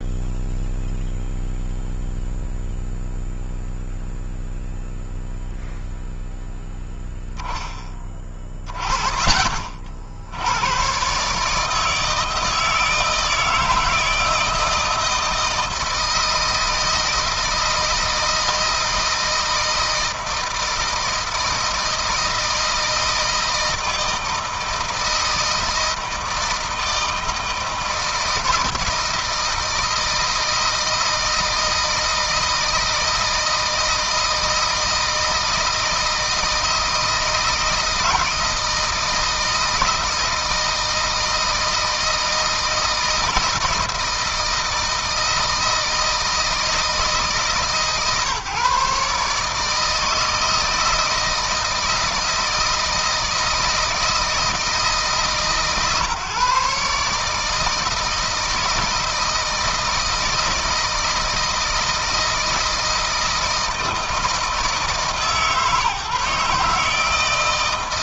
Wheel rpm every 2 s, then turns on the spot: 0, 0, 0, 0, 30, 110, 160, 160, 160, 160, 160, 160, 160, 160, 160, 160, 160, 160, 160, 160, 160, 160, 160, 160, 150, 160, 160, 150, 140, 160, 160, 160, 160, 160.
none